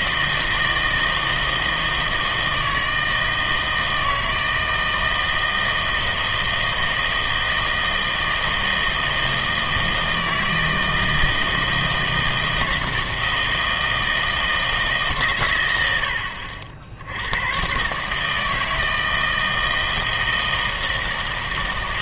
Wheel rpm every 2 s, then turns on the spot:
160, 160, 160, 160, 160, 160, 160, 160, 80, 160, 160.
none